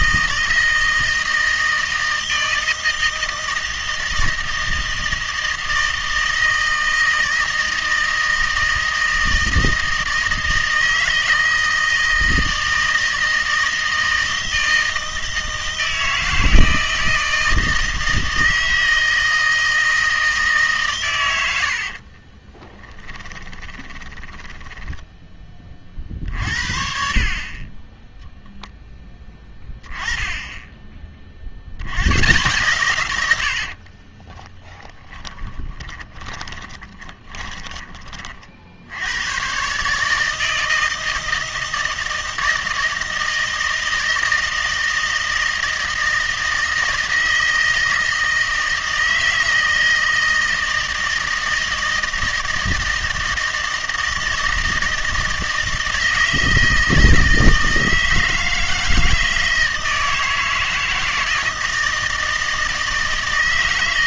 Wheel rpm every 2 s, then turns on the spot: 160, 160, 160, 160, 160, 160, 160, 160, 160, 160, 150, 20, 10, 50, 0, 20, 120, 20, 20, 60, 160, 160, 160, 160, 160, 160, 160, 160, 160, 160, 160, 160.
22-26 34-38